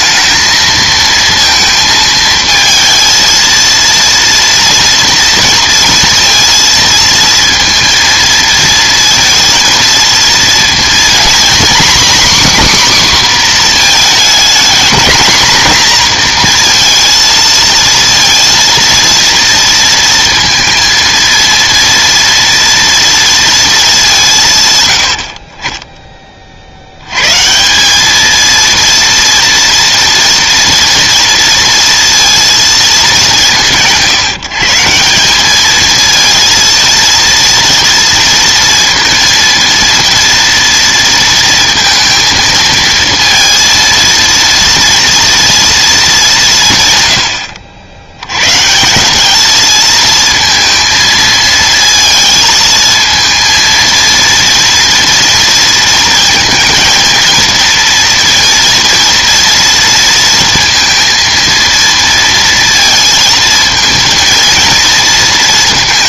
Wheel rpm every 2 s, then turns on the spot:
220, 230, 230, 230, 230, 230, 270, 220, 230, 230, 230, 230, 130, 50, 220, 230, 230, 160, 230, 230, 230, 230, 230, 170, 130, 230, 220, 230, 230, 230, 230, 230, 230.
none